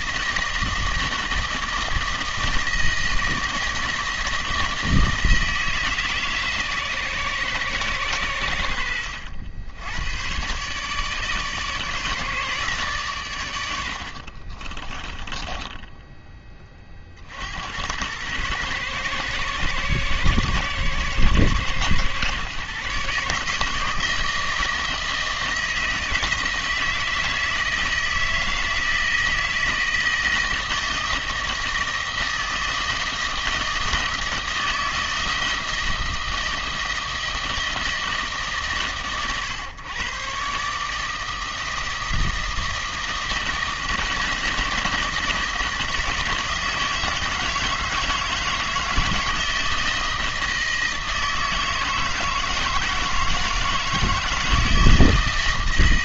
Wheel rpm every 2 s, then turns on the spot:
160, 160, 160, 140, 80, 130, 150, 40, 20, 110, 110, 130, 160, 160, 160, 160, 160, 160, 160, 140, 140, 160, 160, 160, 160, 160, 160, 170.
14-16